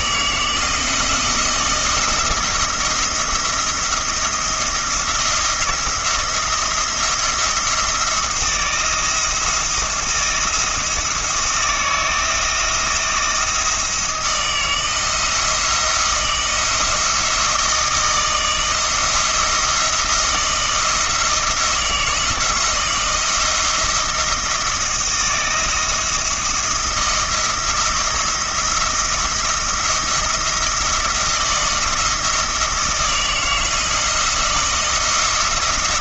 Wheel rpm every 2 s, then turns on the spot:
170, 170, 170, 170, 170, 160, 160, 160, 170, 160, 160, 170, 170, 170, 170, 170, 160, 170.
none